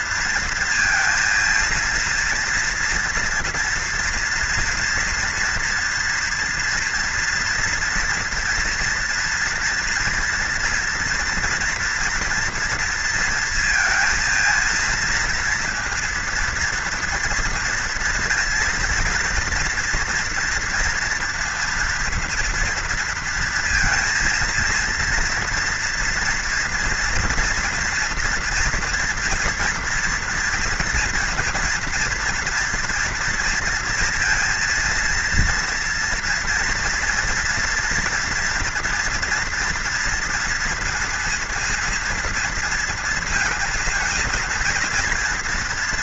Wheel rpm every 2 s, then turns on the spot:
230, 230, 240, 230, 230, 230, 230, 220, 230, 230, 230, 230, 230, 230, 230, 230, 230, 230, 230, 240, 240, 240, 230.
none